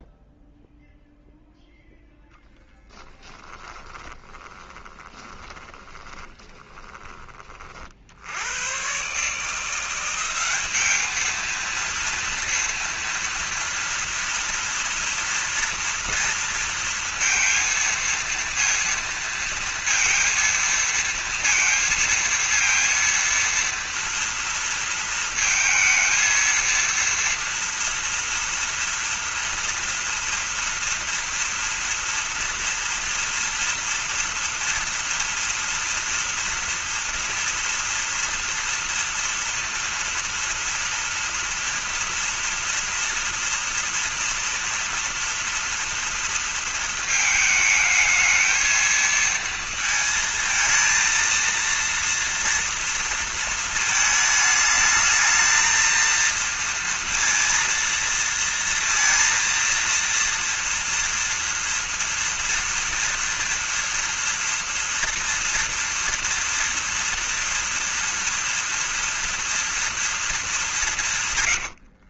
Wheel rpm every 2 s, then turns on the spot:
0, 10, 30, 10, 110, 210, 230, 230, 230, 230, 230, 230, 230, 230, 230, 230, 230, 230, 230, 230, 230, 230, 230, 220, 220, 230, 230, 210, 230, 230, 230, 230, 230, 230, 230, 200.
2-8